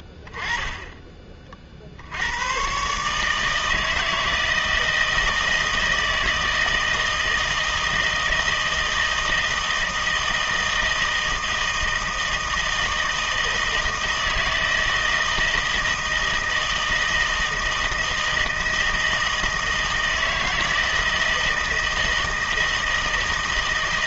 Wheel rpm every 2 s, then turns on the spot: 10, 120, 160, 160, 160, 160, 160, 160, 160, 160, 160, 160.
none